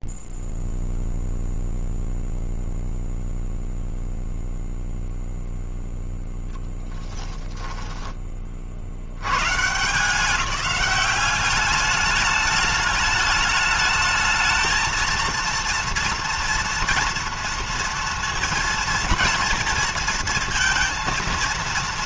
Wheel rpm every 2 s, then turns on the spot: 0, 0, 0, 0, 20, 170, 210, 210, 230, 230, 230.
none